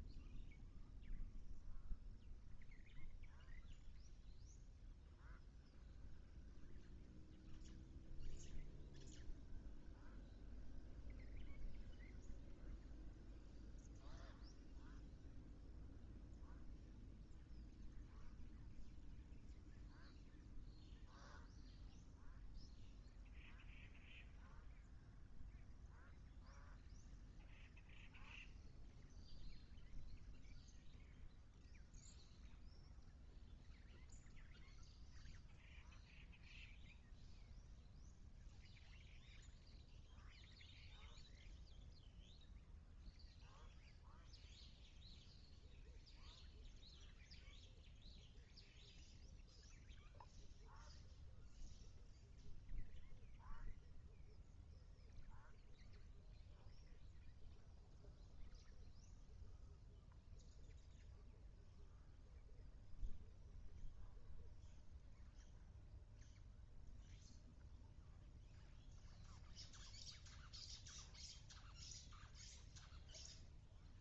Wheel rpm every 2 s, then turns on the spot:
0, 0, 0, 0, 0, 0, 0, 0, 0, 0, 0, 0, 0, 0, 0, 0, 0, 0, 0, 0, 0, 0, 0, 0, 0, 0, 0, 0, 0, 0, 0, 0, 0, 0, 0, 0, 0.
none